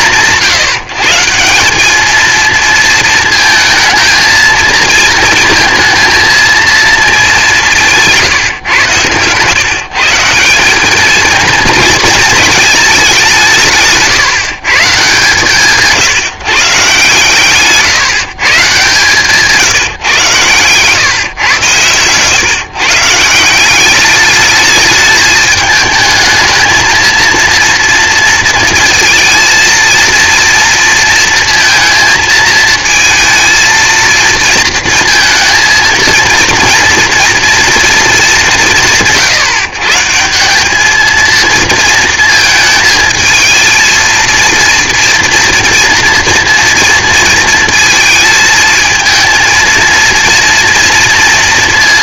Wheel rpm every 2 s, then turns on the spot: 150, 230, 230, 220, 120, 190, 220, 150, 150, 140, 130, 130, 210, 220, 220, 230, 220, 230, 230, 180, 200, 220, 230, 230, 220, 230.
none